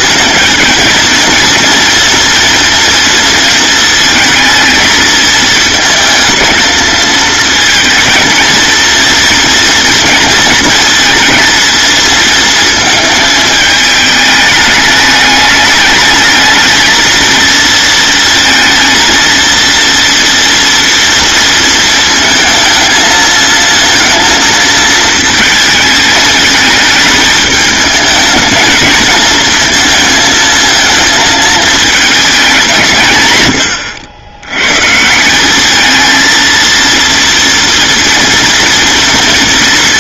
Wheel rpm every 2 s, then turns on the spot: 230, 230, 220, 230, 230, 220, 220, 210, 230, 230, 230, 220, 220, 210, 220, 220, 150, 150, 230, 230.
none